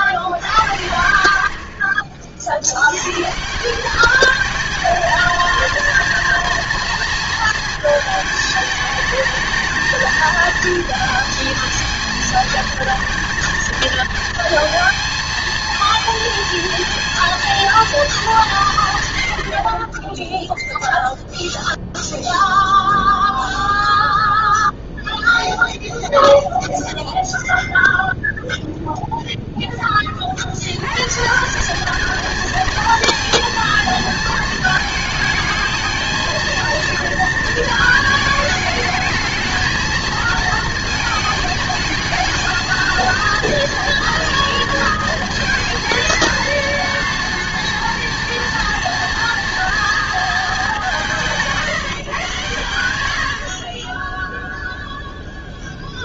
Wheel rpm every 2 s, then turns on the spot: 80, 80, 220, 230, 210, 220, 220, 230, 230, 160, 0, 0, 0, 0, 0, 90, 230, 230, 230, 220, 230, 220, 230, 230, 230, 210, 120, 0.
none